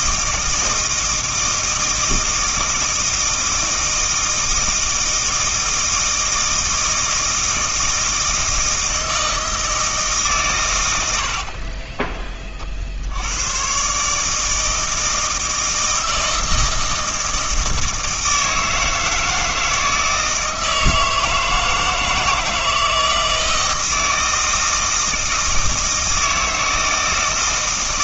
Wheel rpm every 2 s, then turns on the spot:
160, 160, 160, 160, 160, 110, 50, 160, 160, 160, 160, 160, 160, 160.
none